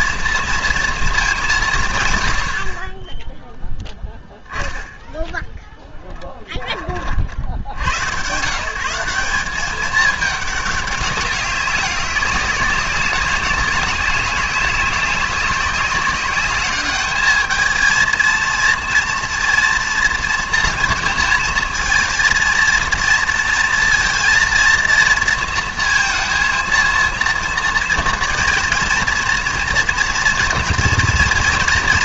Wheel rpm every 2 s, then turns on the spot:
230, 60, 10, 30, 150, 200, 190, 190, 200, 230, 230, 230, 230, 230, 230, 230.
6-8